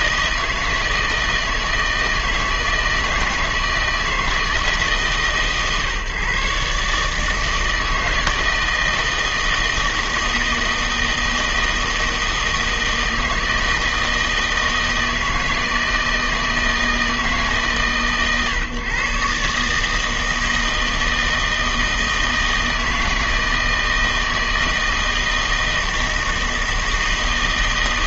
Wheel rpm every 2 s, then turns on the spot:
160, 160, 150, 140, 160, 160, 160, 160, 160, 140, 160, 160, 160, 160.
none